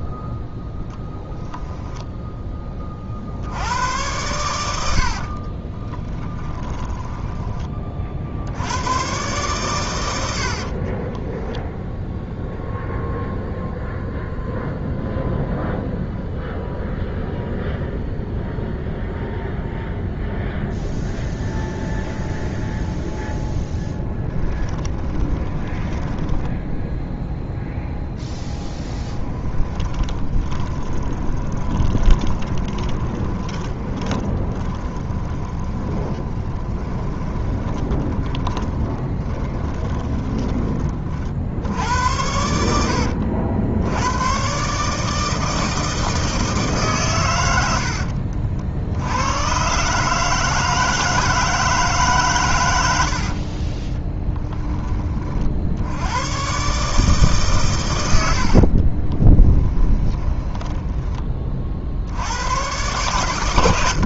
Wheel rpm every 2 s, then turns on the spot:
0, 20, 90, 10, 90, 40, 0, 0, 0, 0, 0, 0, 10, 0, 10, 20, 20, 10, 20, 30, 20, 100, 140, 150, 70, 160, 90, 10, 130, 50, 10, 110.
6-8 10-12 24-26 28-40 58-62